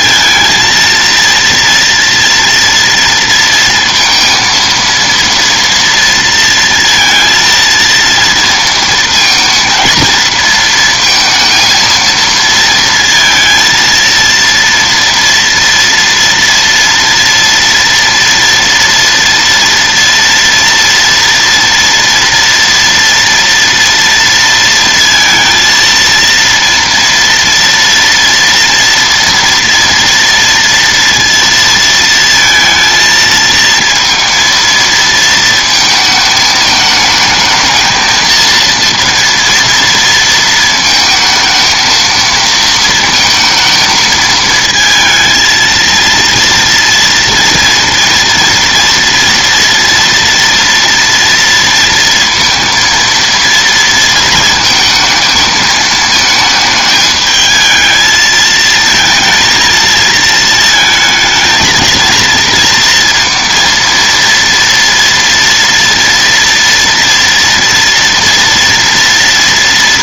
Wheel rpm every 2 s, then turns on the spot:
230, 230, 230, 230, 230, 220, 230, 230, 230, 230, 230, 240, 230, 230, 230, 230, 230, 230, 220, 230, 230, 230, 220, 230, 230, 240, 230, 230, 220, 220, 220, 230, 230, 230, 230.
none